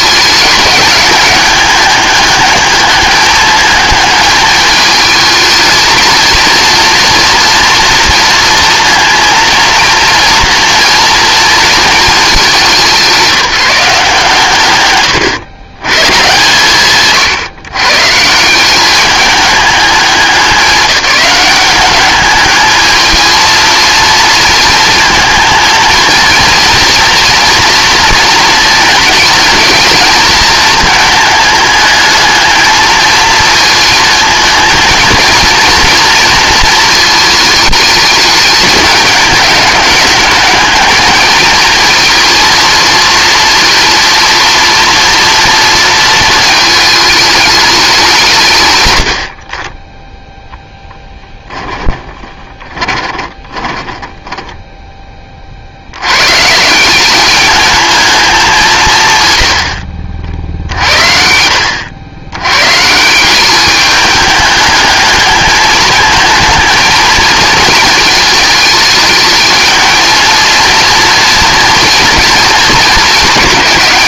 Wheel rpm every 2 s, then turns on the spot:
210, 210, 220, 230, 230, 230, 200, 130, 140, 200, 200, 220, 220, 230, 240, 220, 220, 220, 220, 210, 220, 230, 230, 220, 110, 10, 20, 10, 180, 170, 60, 140, 210, 220, 210, 230, 220.
50-54